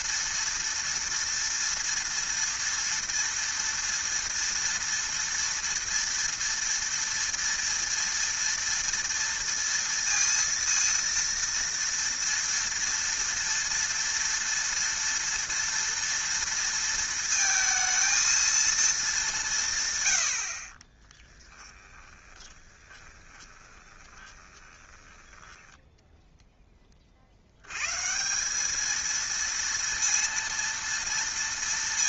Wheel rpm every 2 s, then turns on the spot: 230, 230, 230, 230, 230, 230, 230, 230, 230, 220, 40, 20, 20, 10, 210, 230.
22-26